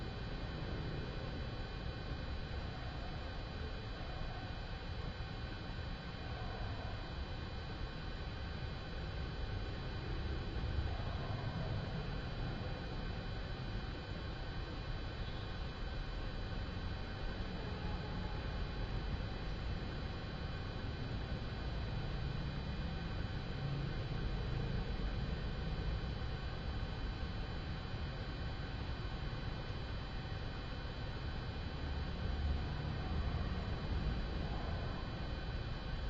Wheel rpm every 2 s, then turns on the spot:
0, 0, 0, 0, 0, 0, 0, 0, 0, 0, 0, 0, 0, 0, 0, 0, 0, 0.
none